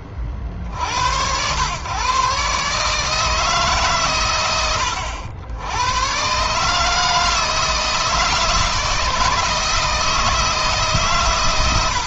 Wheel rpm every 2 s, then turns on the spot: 40, 130, 90, 150, 160, 130.
none